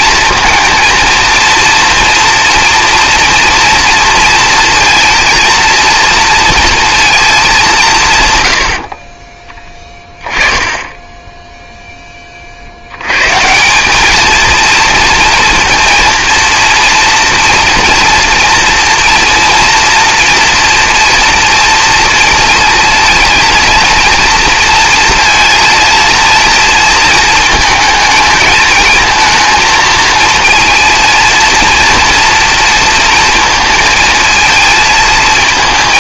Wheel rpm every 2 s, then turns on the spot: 230, 240, 230, 230, 90, 10, 70, 230, 230, 240, 240, 230, 230, 230, 220, 230, 240, 220.
none